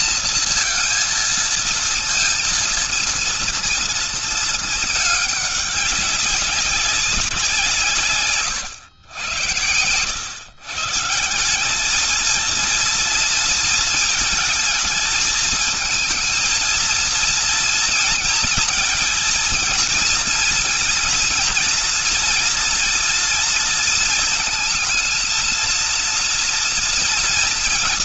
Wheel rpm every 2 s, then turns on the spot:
230, 230, 220, 190, 120, 110, 220, 220, 230, 230, 220, 230, 230, 230.
none